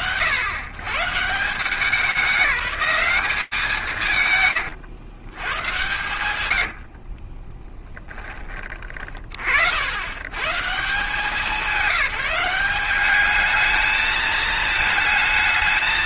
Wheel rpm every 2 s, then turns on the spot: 140, 200, 110, 50, 20, 130, 180, 220.
6-8